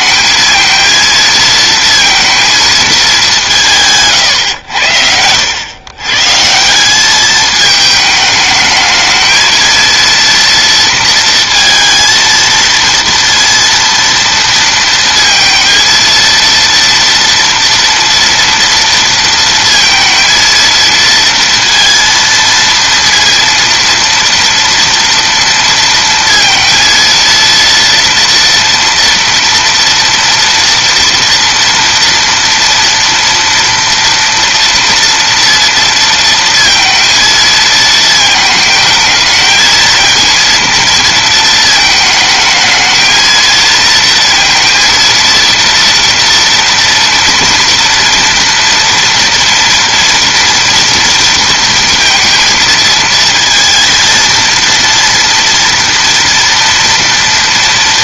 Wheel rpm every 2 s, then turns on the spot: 220, 230, 100, 170, 210, 230, 230, 230, 230, 230, 230, 230, 230, 230, 230, 230, 230, 230, 230, 220, 230, 220, 230, 230, 230, 230, 230, 230, 230.
none